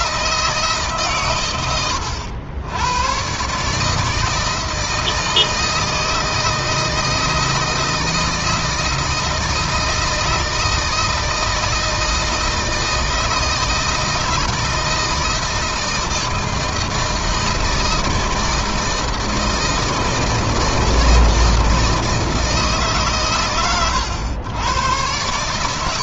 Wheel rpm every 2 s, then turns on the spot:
150, 100, 160, 160, 160, 160, 160, 160, 160, 160, 160, 150, 100.
none